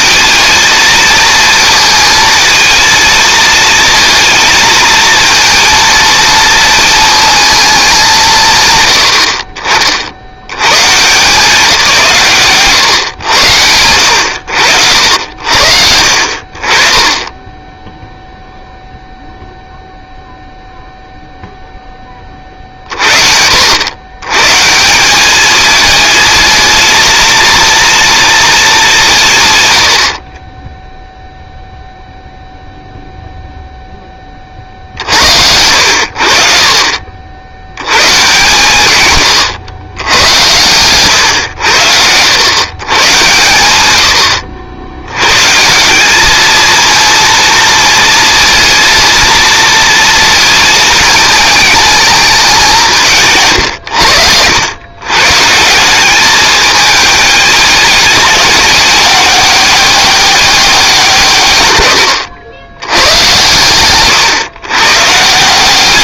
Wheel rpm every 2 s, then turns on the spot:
220, 230, 230, 230, 110, 120, 130, 70, 30, 0, 0, 40, 160, 230, 220, 20, 0, 40, 50, 140, 110, 110, 80, 220, 230, 220, 190, 110, 210, 200, 190, 90, 130.
none